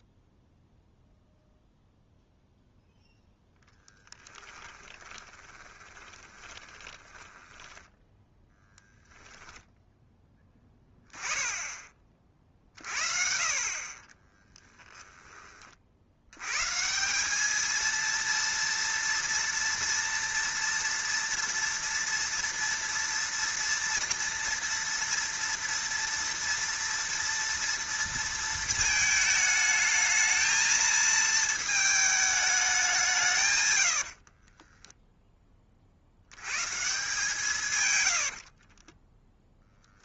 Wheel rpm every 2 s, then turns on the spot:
0, 0, 20, 20, 0, 10, 50, 10, 150, 230, 230, 230, 230, 230, 220, 220, 190, 10, 140, 40.
4-8 14-16 34-36 38-40